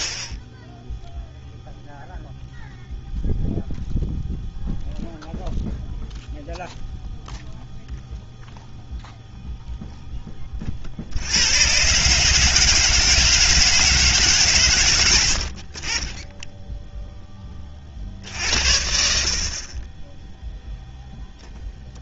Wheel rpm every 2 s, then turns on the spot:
0, 0, 0, 0, 0, 30, 150, 130, 10, 60, 0.
none